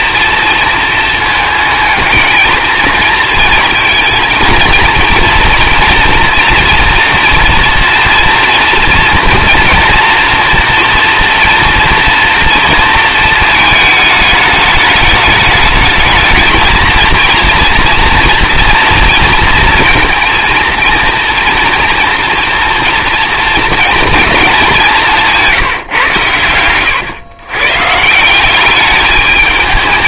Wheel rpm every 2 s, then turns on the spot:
230, 220, 230, 240, 230, 230, 230, 210, 220, 230, 230, 230, 210, 110, 190.
26-28